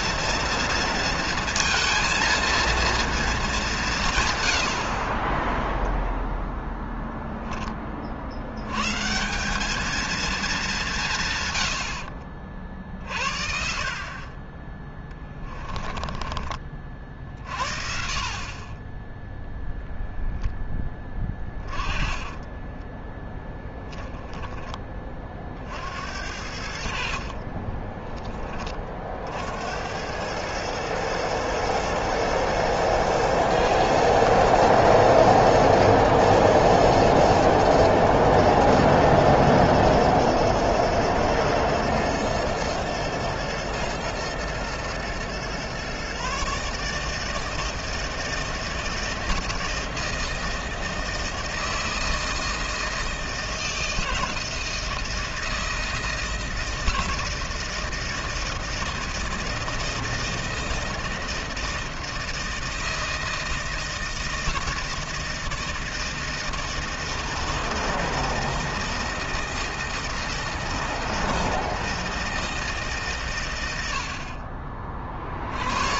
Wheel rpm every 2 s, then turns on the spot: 230, 230, 90, 0, 100, 190, 50, 20, 30, 30, 10, 20, 20, 70, 30, 110, 110, 120, 110, 110, 110, 110, 120, 140, 160, 160, 160, 160, 160, 160, 160, 160, 160, 160, 160, 160, 150, 40.
22-24